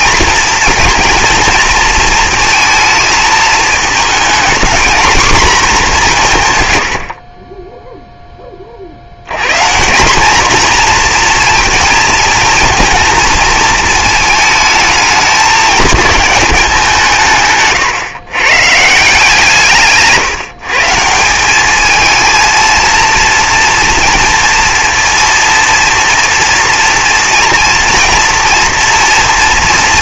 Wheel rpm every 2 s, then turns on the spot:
230, 220, 230, 110, 50, 240, 230, 220, 200, 140, 140, 230, 230, 230, 230.
none